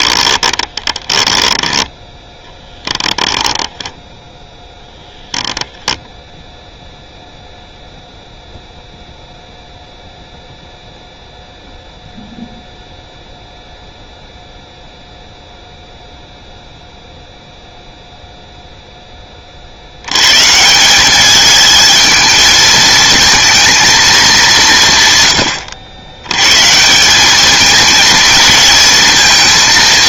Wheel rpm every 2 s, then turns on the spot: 20, 0, 0, 0, 0, 0, 0, 0, 0, 0, 140, 220, 190, 130, 230.
0-2